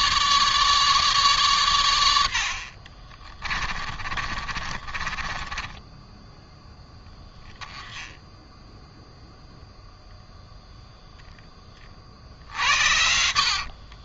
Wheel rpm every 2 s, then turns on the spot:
150, 50, 40, 10, 0, 0, 70.
2-6 12-14